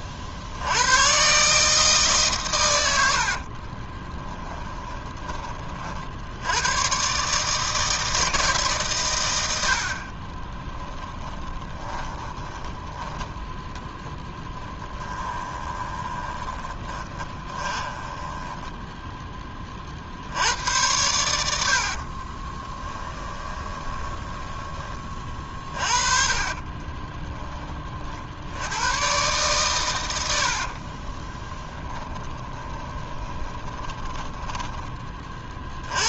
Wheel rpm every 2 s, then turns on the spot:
100, 100, 20, 110, 140, 20, 10, 10, 20, 10, 90, 20, 20, 30, 100, 50, 20, 20.
4-6 10-12 14-20 22-24 26-28 30-34